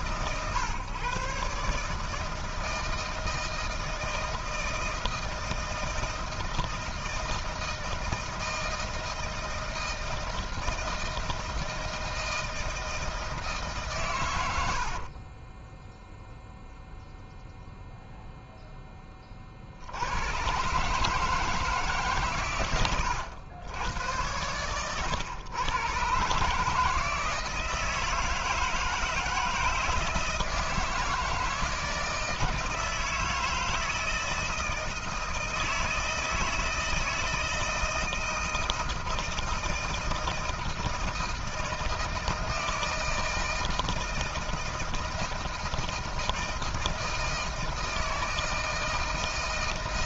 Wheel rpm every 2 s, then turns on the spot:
140, 160, 160, 160, 160, 160, 160, 70, 0, 10, 140, 120, 110, 150, 160, 160, 160, 160, 160, 160, 160, 160, 160, 160, 160.
14-16